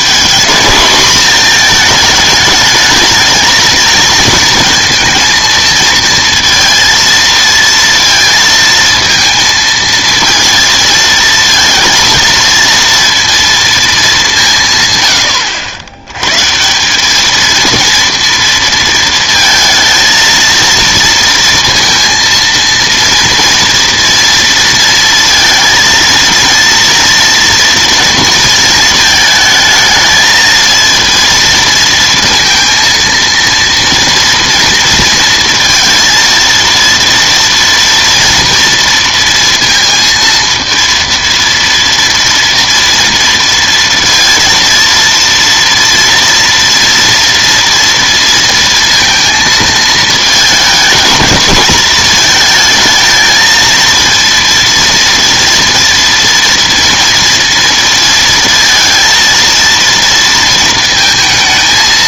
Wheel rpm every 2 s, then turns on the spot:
220, 220, 230, 230, 230, 230, 230, 150, 170, 230, 230, 230, 230, 230, 220, 220, 230, 230, 230, 230, 230, 230, 230, 230, 230, 210, 220, 230, 230, 220, 230.
none